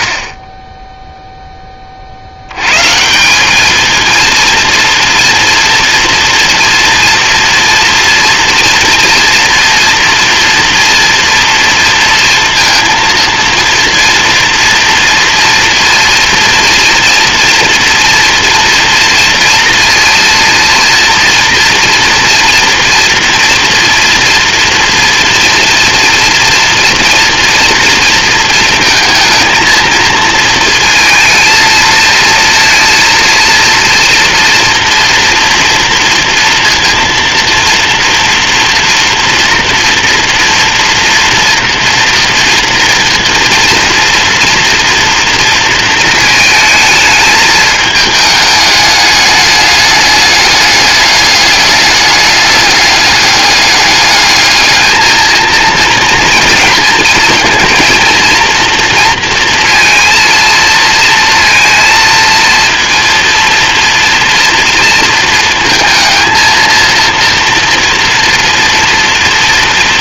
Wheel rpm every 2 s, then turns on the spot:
20, 110, 230, 240, 240, 230, 230, 230, 230, 230, 230, 230, 240, 230, 220, 230, 230, 240, 240, 230, 230, 230, 230, 220, 210, 200, 210, 220, 230, 230, 230, 230, 230, 230, 230.
none